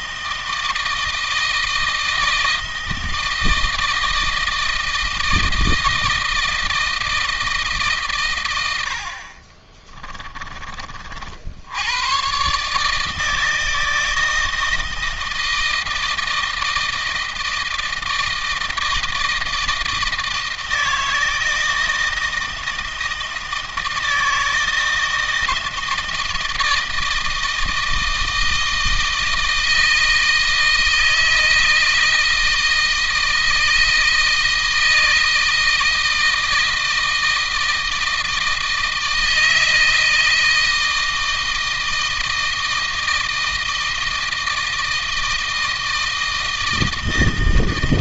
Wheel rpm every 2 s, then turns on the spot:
160, 160, 160, 160, 90, 40, 150, 160, 160, 160, 160, 160, 160, 160, 160, 160, 160, 160, 160, 160, 160, 160, 160, 160.
none